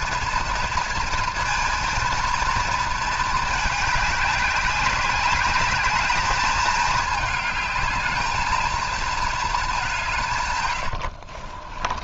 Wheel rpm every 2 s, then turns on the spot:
230, 230, 200, 210, 220, 110.
none